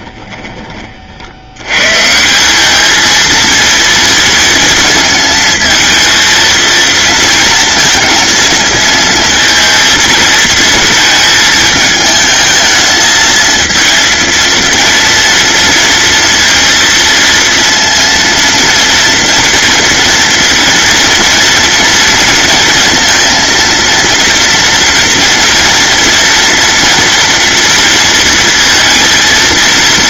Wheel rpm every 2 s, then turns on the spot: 30, 210, 230, 230, 230, 230, 220, 230, 230, 230, 230, 230, 230, 230, 230.
none